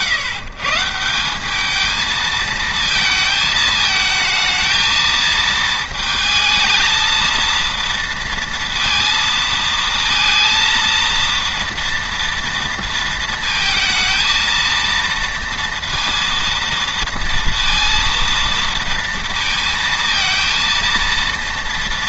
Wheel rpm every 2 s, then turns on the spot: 130, 220, 220, 220, 230, 230, 230, 220, 230, 230, 230.
none